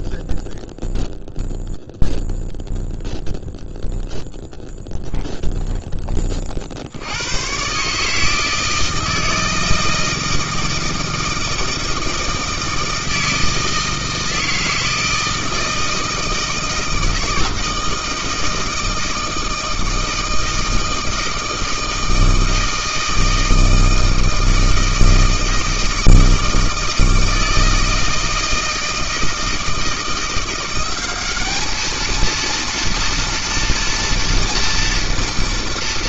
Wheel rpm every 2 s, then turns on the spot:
0, 0, 0, 100, 160, 160, 160, 160, 160, 160, 160, 160, 160, 160, 160, 210, 230, 190.
none